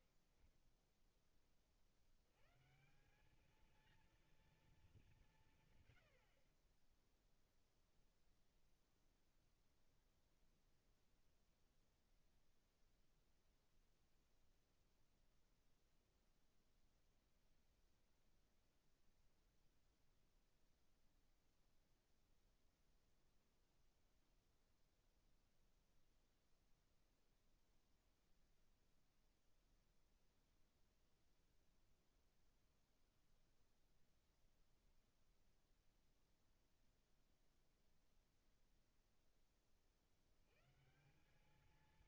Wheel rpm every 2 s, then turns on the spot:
60, 110, 230, 80, 10, 0, 0, 0, 0, 0, 0, 0, 0, 0, 0, 0, 0, 0, 0, 0, 80.
6-8